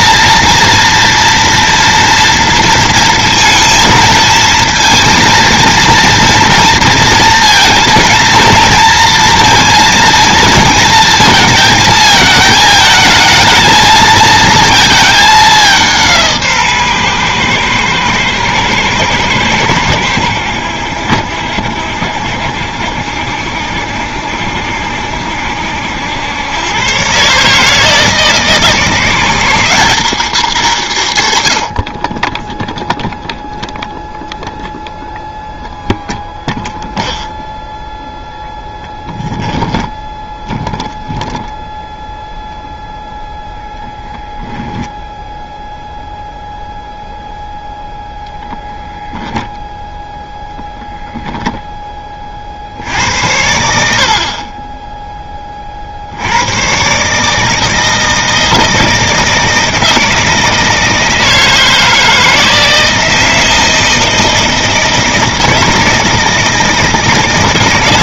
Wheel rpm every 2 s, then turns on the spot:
230, 230, 230, 230, 230, 230, 220, 230, 150, 110, 90, 70, 70, 110, 160, 200, 0, 0, 0, 0, 0, 0, 0, 0, 0, 0, 60, 30, 120, 160, 160, 160, 160, 160.
none